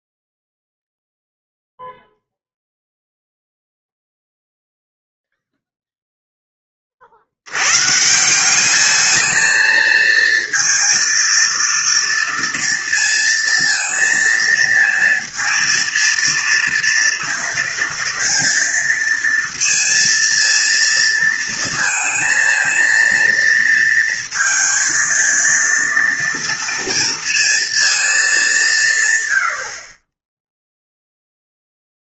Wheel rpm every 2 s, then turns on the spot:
0, 0, 0, 20, 210, 230, 230, 220, 230, 230, 230, 230, 230, 230, 140, 0.
none